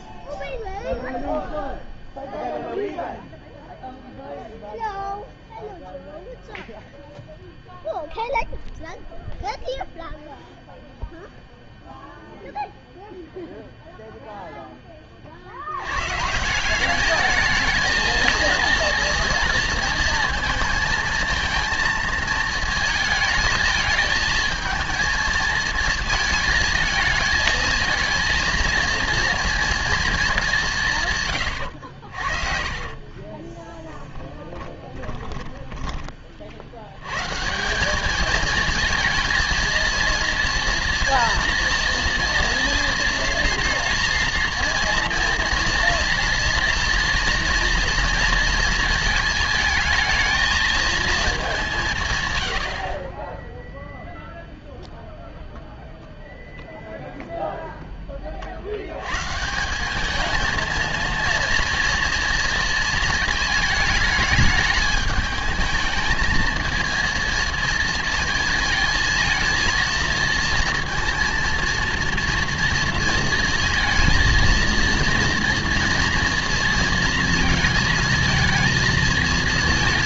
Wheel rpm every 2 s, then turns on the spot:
0, 0, 0, 0, 0, 0, 0, 10, 170, 230, 220, 220, 220, 220, 230, 190, 50, 20, 70, 220, 230, 230, 230, 230, 230, 220, 90, 0, 0, 60, 220, 230, 210, 220, 220, 230, 230, 230, 230, 220.
32-36 52-54